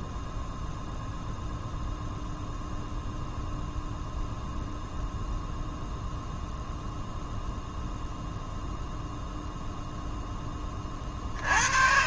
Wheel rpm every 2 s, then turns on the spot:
0, 0, 0, 0, 0, 20.
none